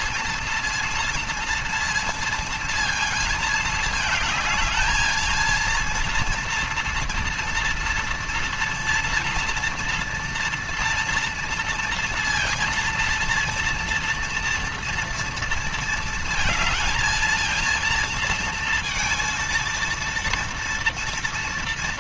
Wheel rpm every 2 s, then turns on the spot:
230, 230, 220, 230, 240, 230, 230, 230, 220, 230, 230.
none